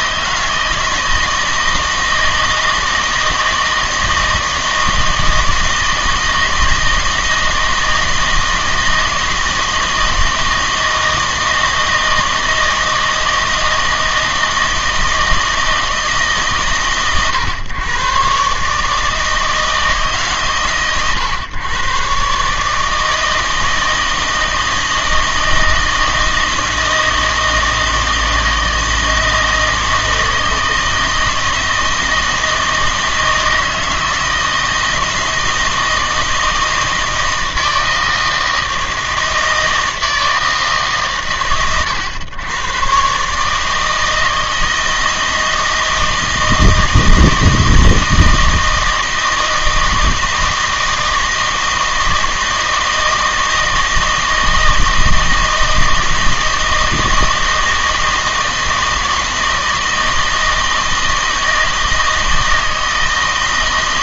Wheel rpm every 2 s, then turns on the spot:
160, 160, 160, 160, 160, 160, 160, 160, 130, 150, 130, 150, 160, 160, 160, 160, 160, 170, 160, 160, 150, 120, 160, 160, 160, 160, 160, 160, 160, 160, 160, 160.
none